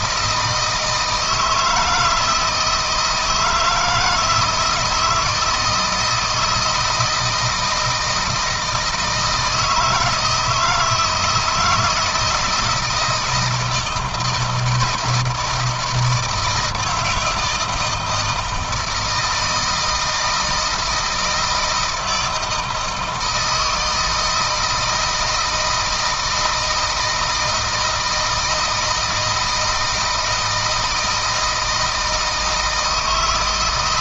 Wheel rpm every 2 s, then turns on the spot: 160, 160, 160, 160, 160, 160, 160, 170, 160, 160, 160, 160, 160, 160, 160, 160, 160.
none